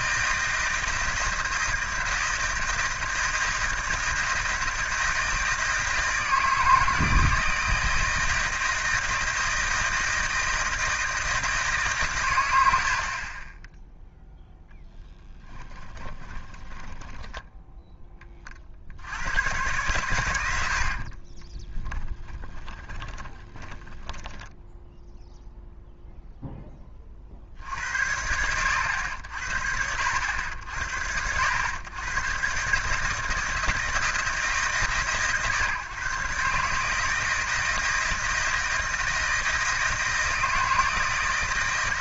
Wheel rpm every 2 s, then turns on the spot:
160, 160, 160, 160, 160, 160, 80, 10, 20, 60, 80, 20, 10, 20, 90, 70, 140, 150, 150, 160, 160.
16-18 20-24